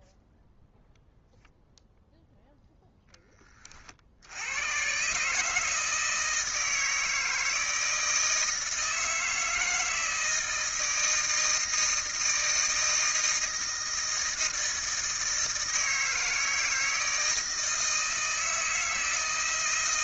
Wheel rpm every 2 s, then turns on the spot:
0, 0, 100, 160, 160, 160, 160, 160, 160, 160.
none